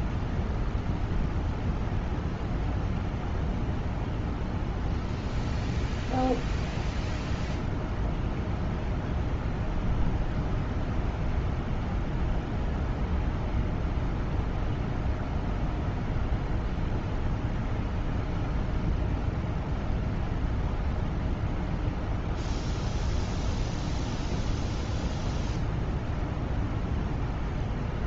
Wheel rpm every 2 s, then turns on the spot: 0, 0, 0, 0, 0, 0, 0, 0, 0, 0, 0, 0, 0, 0.
none